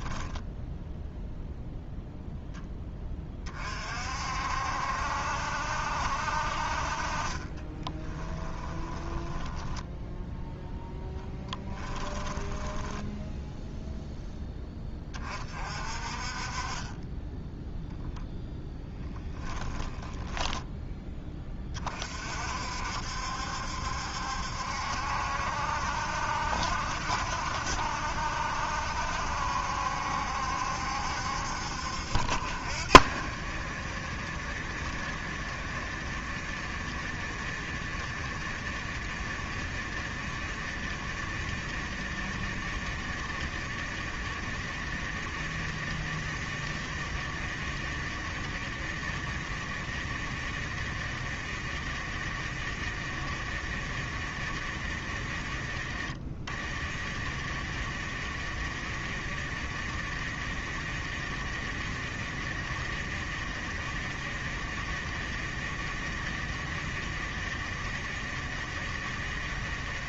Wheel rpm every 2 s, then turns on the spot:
0, 20, 70, 40, 10, 10, 10, 20, 20, 10, 20, 60, 70, 60, 70, 70, 60, 50, 50, 50, 50, 50, 50, 50, 50, 50, 50, 40, 40, 50, 50, 50, 50, 50, 50.
8-14 18-22